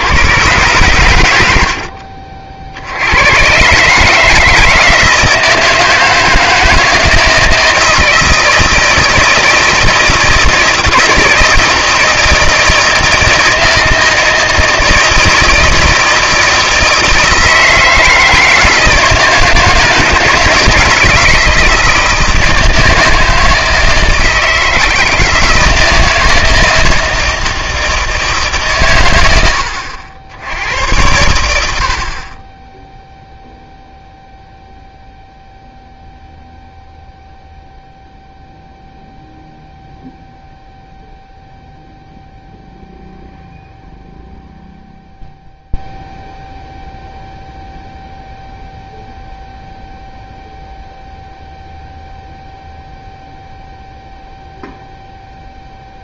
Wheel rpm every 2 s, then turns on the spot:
110, 60, 160, 160, 160, 160, 160, 160, 160, 160, 160, 160, 160, 160, 140, 90, 10, 0, 0, 0, 0, 0, 0, 0, 0, 0, 0, 0.
none